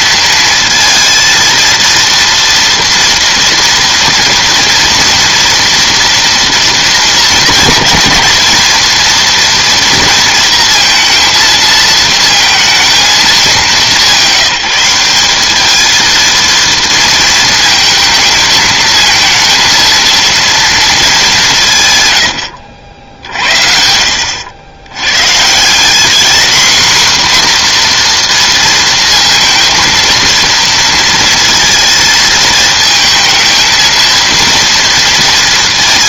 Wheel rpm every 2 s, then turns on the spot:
230, 230, 230, 230, 220, 230, 230, 190, 230, 220, 230, 70, 90, 240, 230, 230, 220, 220.
none